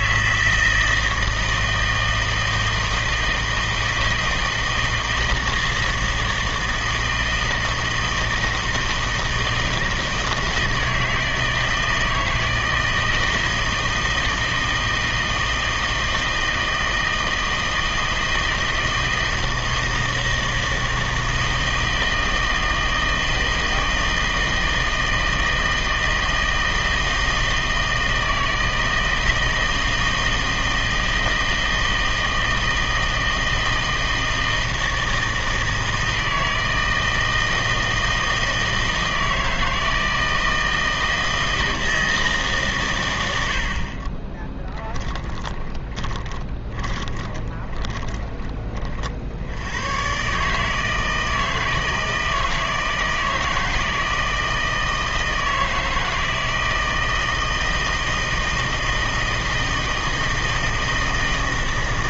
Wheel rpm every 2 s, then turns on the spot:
160, 160, 160, 160, 160, 160, 160, 160, 160, 160, 160, 160, 160, 160, 160, 160, 160, 160, 160, 160, 160, 120, 10, 20, 40, 160, 160, 160, 160, 160, 160.
44-48